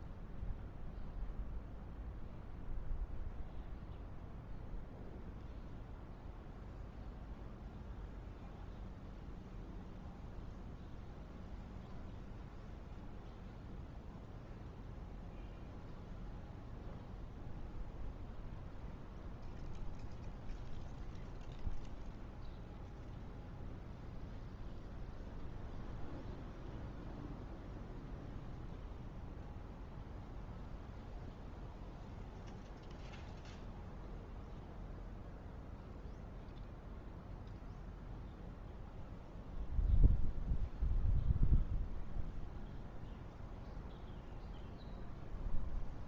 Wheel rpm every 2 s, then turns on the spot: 0, 0, 0, 0, 0, 0, 0, 0, 0, 0, 0, 0, 0, 0, 0, 0, 0, 0, 0, 0, 0, 0, 0.
none